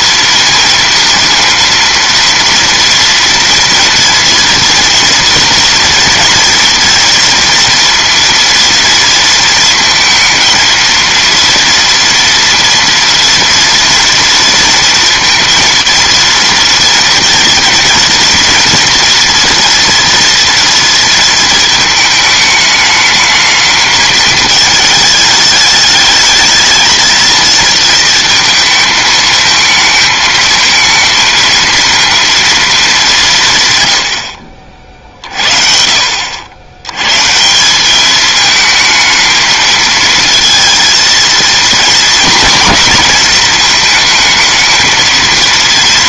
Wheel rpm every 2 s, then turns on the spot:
230, 230, 230, 240, 230, 230, 230, 230, 230, 230, 230, 210, 220, 220, 220, 220, 230, 50, 90, 220, 220, 220, 220.
none